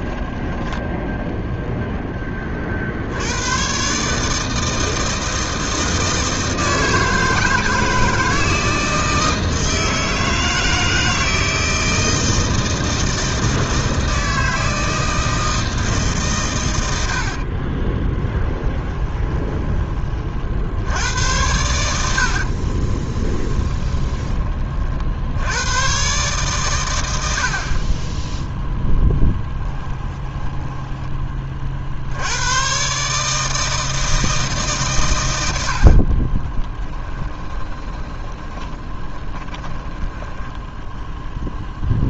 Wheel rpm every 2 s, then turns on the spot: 10, 60, 160, 160, 160, 160, 160, 160, 100, 20, 80, 30, 40, 130, 0, 10, 120, 140, 10, 20, 10.
0-2 18-20 22-24 30-32 36-40